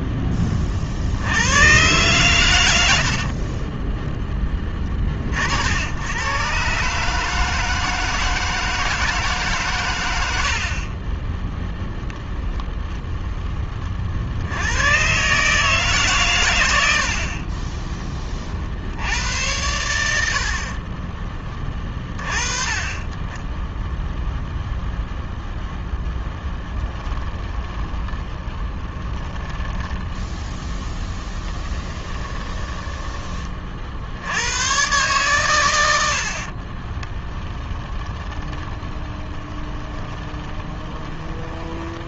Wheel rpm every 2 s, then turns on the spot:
70, 80, 50, 140, 160, 30, 10, 120, 70, 70, 30, 30, 0, 10, 10, 10, 20, 120, 20, 20, 20.
2-4 20-22 26-32 36-42